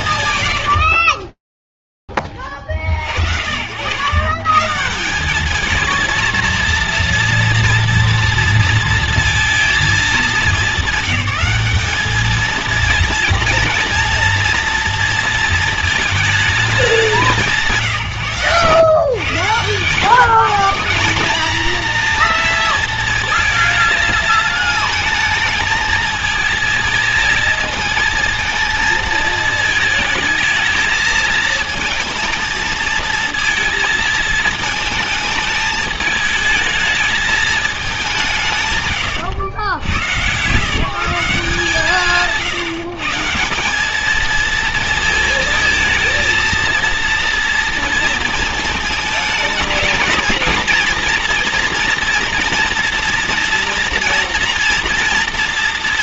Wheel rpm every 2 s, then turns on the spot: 90, 60, 210, 240, 230, 200, 240, 230, 170, 110, 220, 220, 220, 220, 220, 230, 230, 220, 220, 100, 170, 160, 230, 230, 220, 230, 240, 230.
18-20